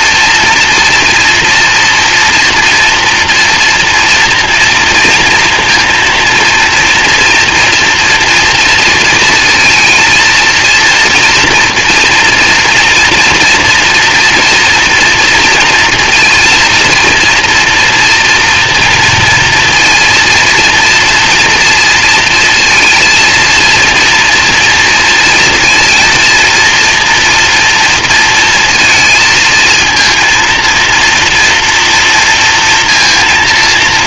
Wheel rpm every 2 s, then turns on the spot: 240, 240, 230, 230, 230, 230, 230, 240, 230, 230, 230, 230, 230, 240, 230, 230, 230.
none